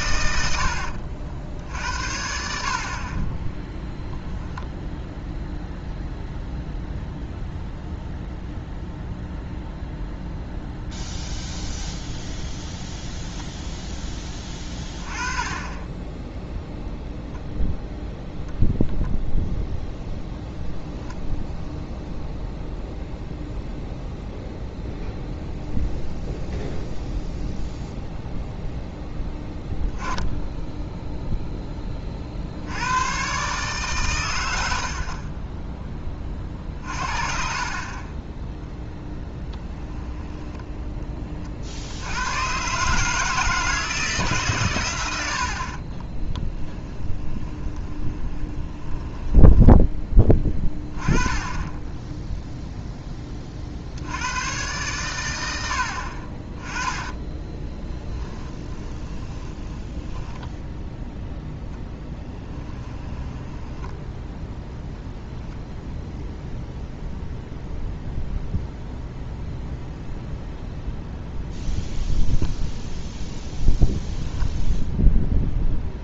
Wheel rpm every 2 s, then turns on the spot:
80, 60, 0, 0, 0, 0, 0, 20, 0, 0, 0, 0, 0, 0, 0, 10, 80, 80, 40, 10, 10, 120, 130, 10, 20, 10, 0, 120, 20, 20, 10, 20, 0, 0, 0, 0, 0, 0.
40-42 46-50 58-64